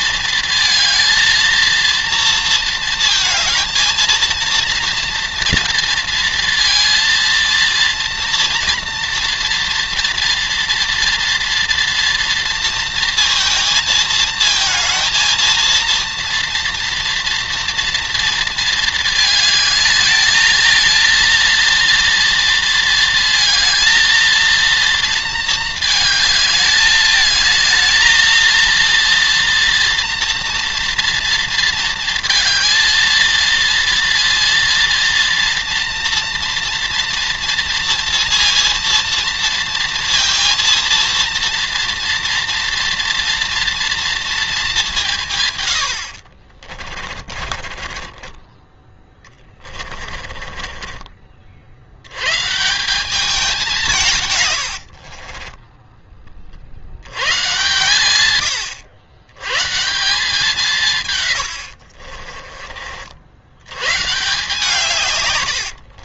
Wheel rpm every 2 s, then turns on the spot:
220, 230, 230, 230, 230, 240, 230, 230, 230, 230, 220, 230, 230, 210, 220, 230, 230, 230, 230, 230, 230, 230, 210, 50, 20, 40, 180, 60, 90, 120, 110, 60, 140.
46-48 50-52 54-56 60-62 64-66